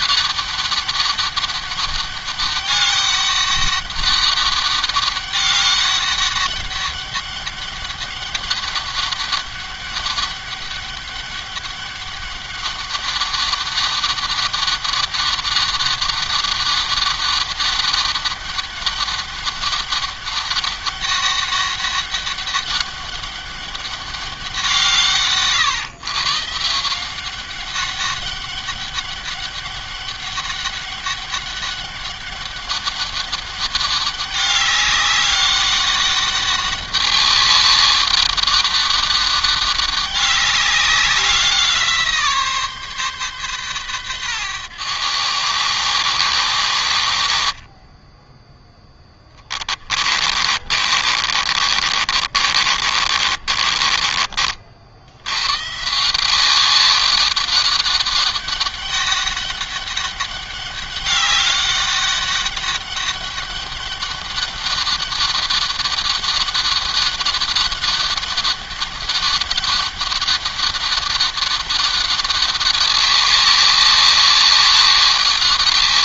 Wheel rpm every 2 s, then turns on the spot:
200, 200, 200, 200, 200, 200, 200, 200, 200, 200, 200, 200, 160, 170, 200, 200, 200, 200, 200, 200, 190, 140, 90, 50, 10, 40, 40, 80, 190, 200, 200, 200, 200, 200, 200, 200, 200, 200.
48-54